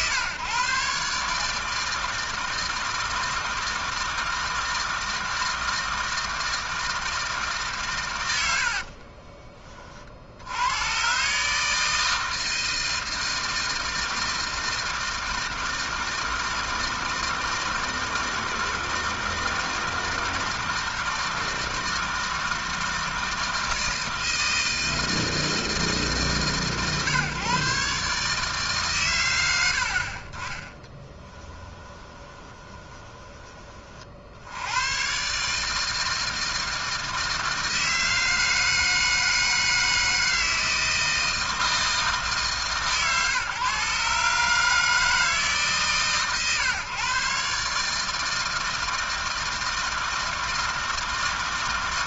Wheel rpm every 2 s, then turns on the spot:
140, 160, 160, 160, 70, 110, 160, 160, 160, 160, 160, 160, 160, 130, 130, 30, 20, 90, 160, 160, 160, 140, 150, 130, 160, 160.
8-10 32-34